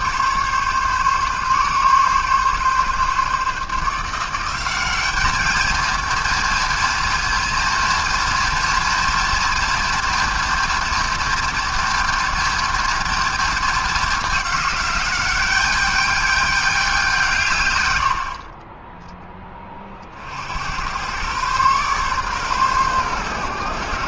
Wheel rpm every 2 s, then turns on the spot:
140, 140, 210, 230, 230, 230, 230, 200, 190, 20, 110, 120.
none